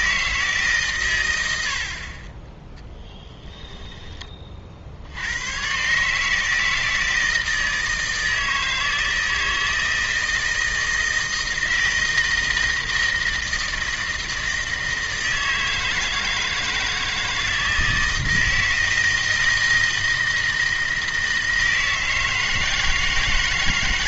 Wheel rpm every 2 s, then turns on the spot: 140, 10, 40, 160, 160, 160, 160, 160, 160, 160, 160, 160.
none